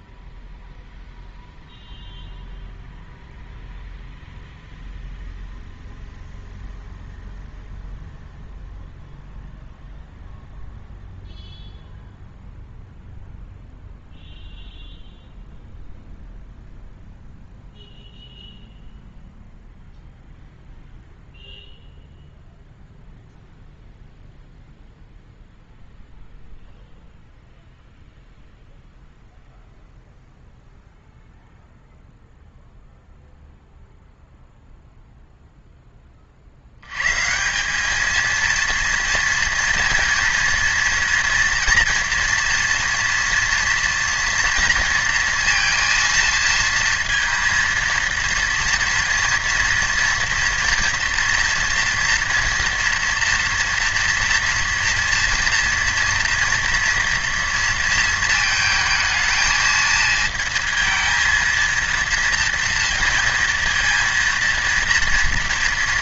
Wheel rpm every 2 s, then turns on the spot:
0, 0, 0, 0, 0, 0, 0, 0, 0, 0, 0, 0, 0, 0, 0, 0, 0, 0, 80, 230, 230, 230, 230, 230, 230, 230, 240, 230, 230, 220, 230, 230, 230.
none